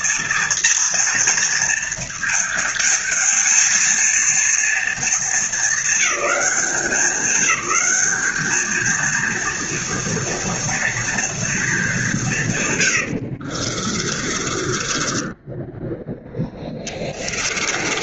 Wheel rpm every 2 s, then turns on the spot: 230, 220, 220, 200, 220, 230, 130, 30, 10.
12-18